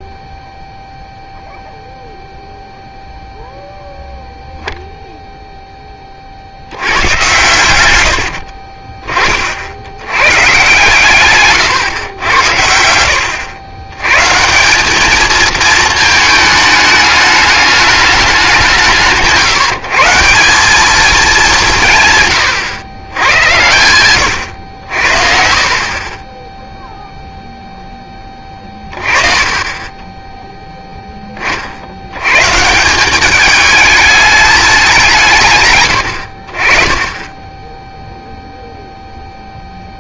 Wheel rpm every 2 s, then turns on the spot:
0, 0, 0, 80, 40, 140, 90, 190, 210, 170, 210, 110, 80, 0, 20, 0, 160, 200, 30, 0.
8-10 28-30